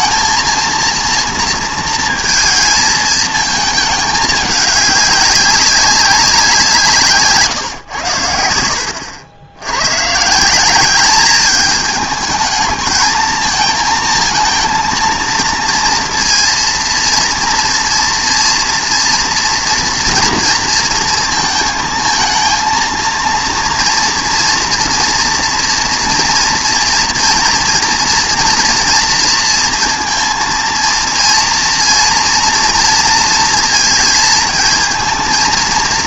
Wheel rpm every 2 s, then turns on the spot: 230, 220, 200, 160, 70, 200, 220, 230, 230, 230, 230, 230, 240, 240, 240, 230, 230, 220.
8-10